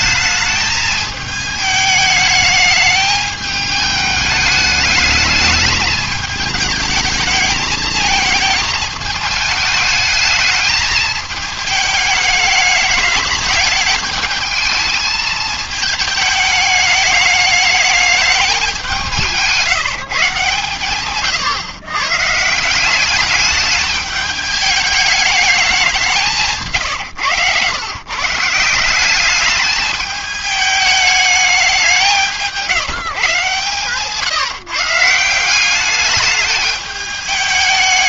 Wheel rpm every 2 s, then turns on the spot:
220, 210, 210, 220, 220, 210, 210, 220, 210, 200, 130, 170, 210, 150, 170, 210, 160, 150, 210.
26-28